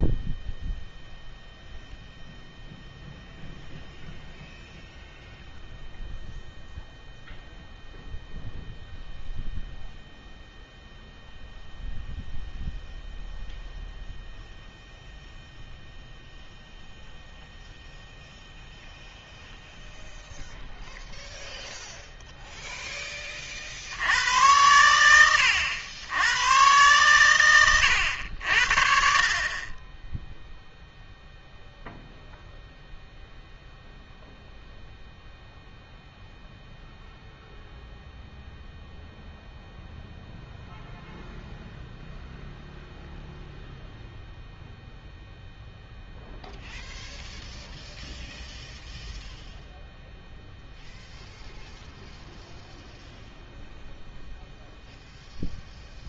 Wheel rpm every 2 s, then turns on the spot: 0, 0, 0, 0, 0, 0, 0, 0, 0, 0, 0, 0, 90, 110, 70, 0, 0, 0, 0, 0, 0, 0, 0, 0, 0, 0, 0, 0.
none